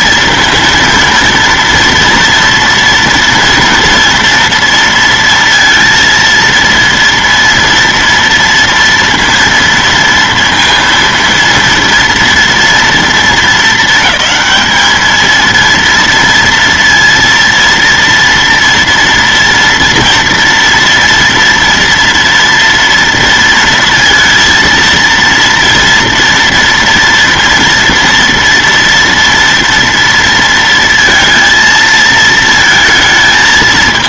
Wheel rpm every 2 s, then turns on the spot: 230, 230, 230, 230, 230, 230, 230, 220, 230, 230, 230, 230, 230, 230, 230, 230, 230.
none